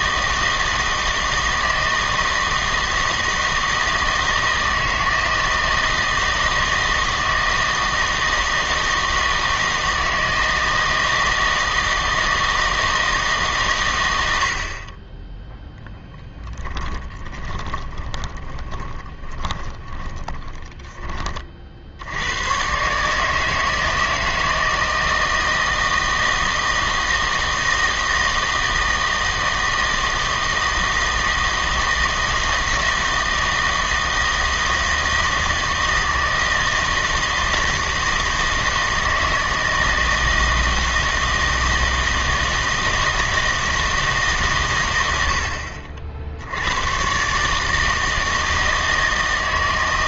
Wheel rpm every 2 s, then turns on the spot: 160, 160, 160, 160, 160, 160, 160, 60, 10, 20, 20, 120, 160, 160, 160, 160, 160, 160, 160, 160, 160, 160, 130, 90, 160.
16-22